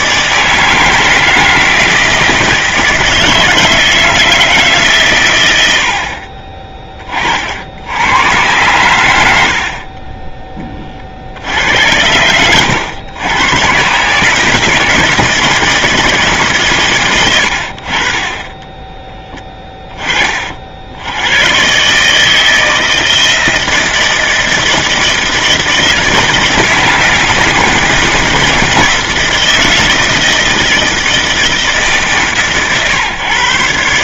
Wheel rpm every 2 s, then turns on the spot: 160, 160, 150, 30, 100, 30, 100, 160, 130, 10, 70, 160, 160, 160, 160, 160, 130.
none